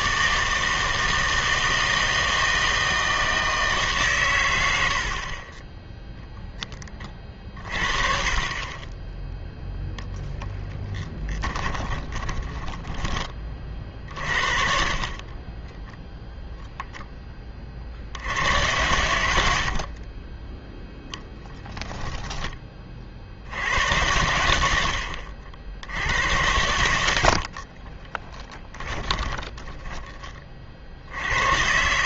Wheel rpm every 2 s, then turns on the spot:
160, 160, 70, 20, 20, 10, 10, 40, 0, 100, 0, 20, 90, 90, 20, 50.
4-6 12-14 28-30